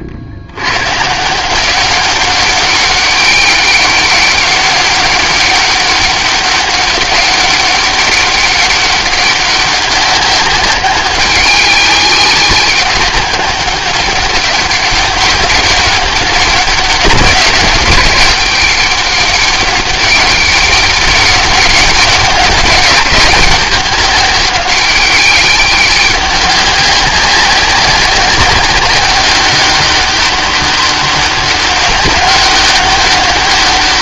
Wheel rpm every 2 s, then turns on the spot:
120, 200, 200, 200, 190, 190, 200, 200, 190, 190, 200, 200, 200, 190, 190, 200, 200.
none